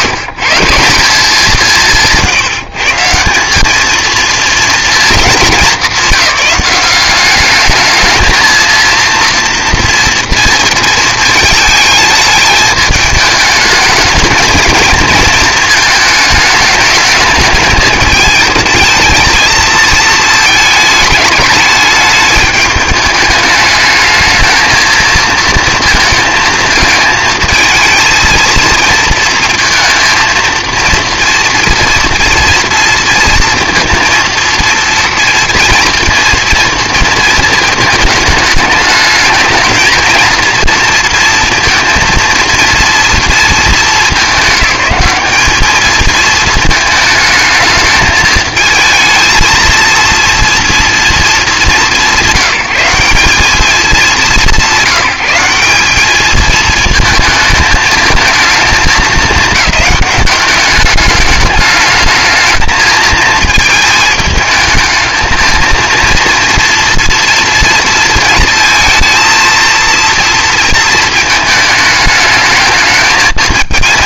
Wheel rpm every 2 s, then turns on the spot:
170, 160, 220, 190, 230, 220, 210, 220, 210, 220, 210, 210, 230, 220, 230, 230, 230, 230, 230, 210, 230, 230, 210, 220, 220, 220, 170, 180, 220, 220, 210, 220, 220, 230, 230, 230, 220.
none